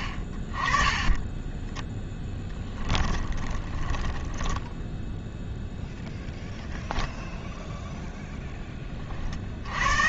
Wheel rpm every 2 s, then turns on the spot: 40, 10, 10, 10, 10.
2-6